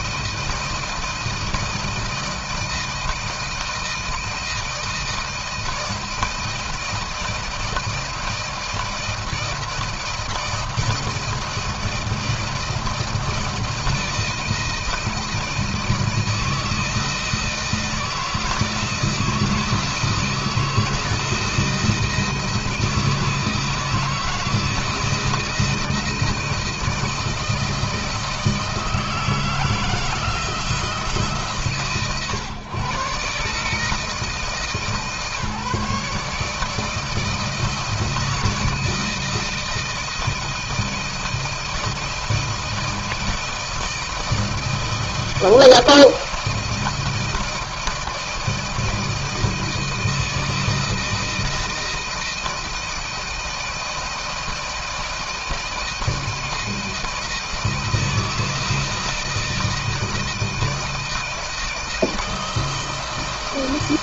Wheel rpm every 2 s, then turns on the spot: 160, 160, 160, 160, 160, 160, 160, 160, 160, 160, 160, 160, 160, 160, 160, 160, 130, 160, 160, 170, 160, 160, 160, 160, 160, 160, 160, 160, 160, 160, 160, 160.
none